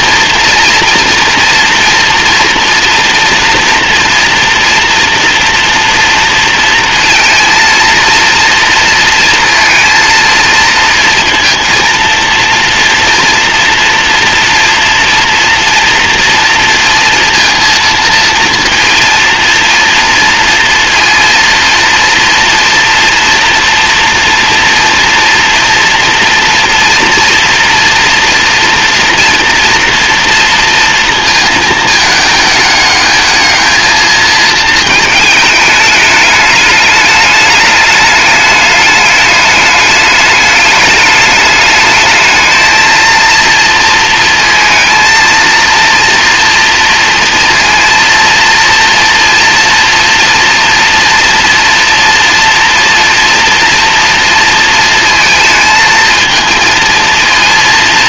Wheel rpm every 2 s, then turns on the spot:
230, 230, 230, 230, 230, 230, 230, 240, 230, 230, 230, 230, 230, 240, 230, 230, 210, 220, 210, 210, 210, 230, 230, 230, 230, 230, 230, 230, 230.
none